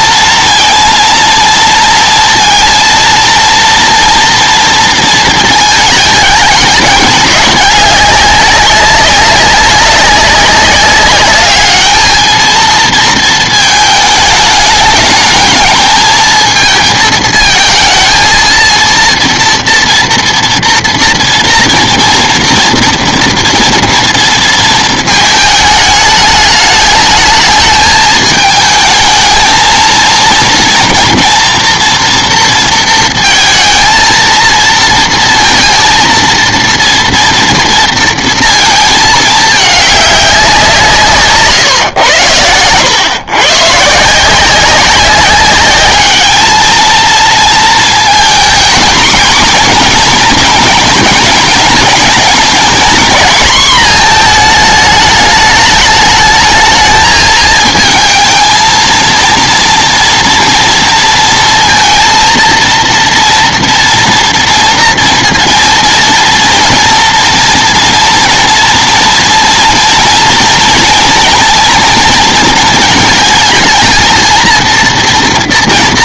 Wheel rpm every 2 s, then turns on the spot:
230, 230, 230, 200, 200, 200, 220, 210, 220, 230, 230, 230, 220, 210, 220, 230, 230, 230, 230, 220, 170, 110, 190, 220, 230, 220, 230, 220, 220, 230, 230, 230, 230, 230, 230, 230, 230, 230.
none